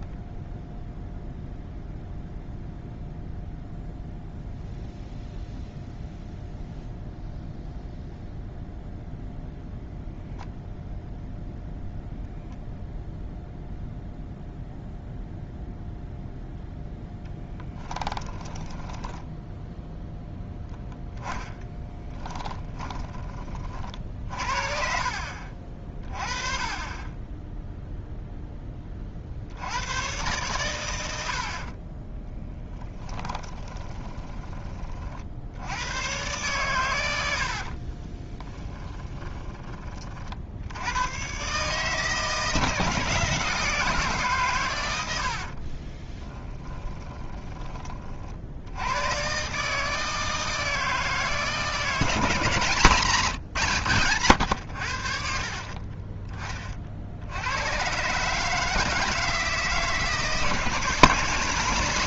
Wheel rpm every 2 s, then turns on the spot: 0, 0, 0, 0, 0, 0, 0, 0, 0, 10, 0, 20, 50, 20, 30, 110, 10, 40, 90, 20, 110, 160, 100, 20, 100, 160, 130, 70, 40, 160, 160.
18-20 22-24 32-34 38-40 46-48